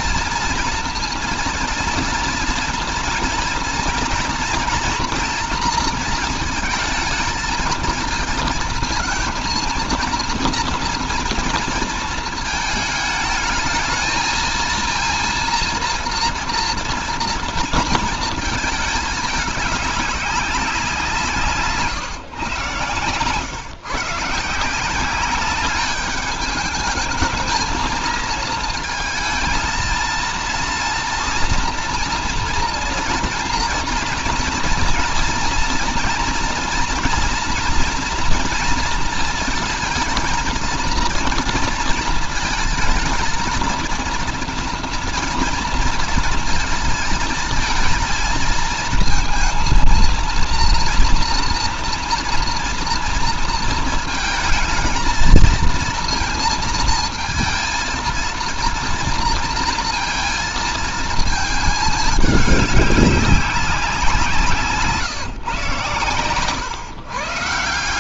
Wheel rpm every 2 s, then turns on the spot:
230, 230, 240, 230, 230, 230, 220, 230, 230, 220, 200, 140, 150, 210, 230, 230, 230, 230, 230, 230, 230, 220, 230, 230, 230, 230, 230, 220, 230, 230, 230, 210, 170, 130.
none